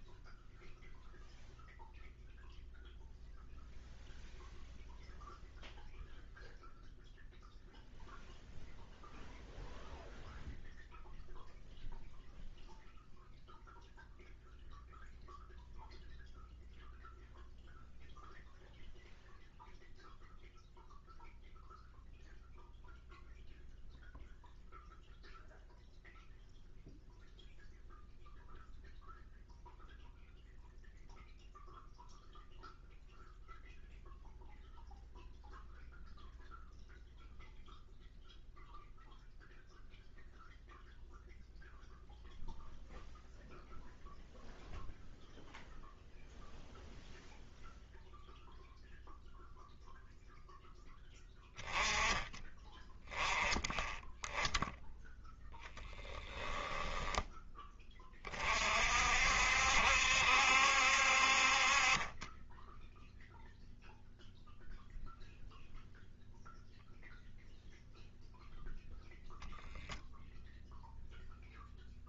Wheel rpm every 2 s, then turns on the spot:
0, 0, 0, 0, 0, 0, 0, 0, 0, 0, 0, 0, 0, 0, 0, 0, 0, 0, 0, 0, 0, 0, 0, 0, 0, 10, 10, 0, 10, 50, 60, 10, 0, 0, 0, 0.
56-58